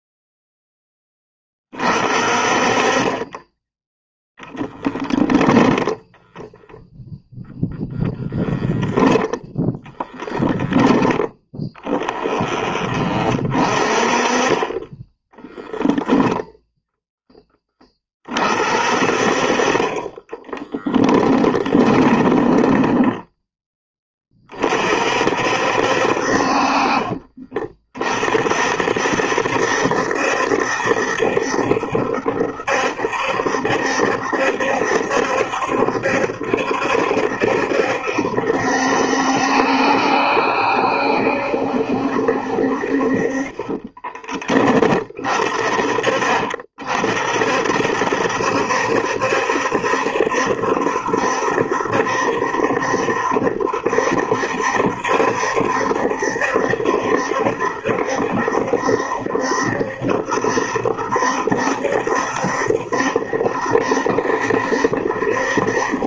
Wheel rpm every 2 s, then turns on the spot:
10, 30, 10, 0, 0, 20, 30, 20, 0, 40, 10, 10, 40, 40, 60, 70, 70, 70, 70, 70, 70, 50, 30, 50, 70, 70, 70, 70, 70, 70, 70, 70, 70.
4-6 20-24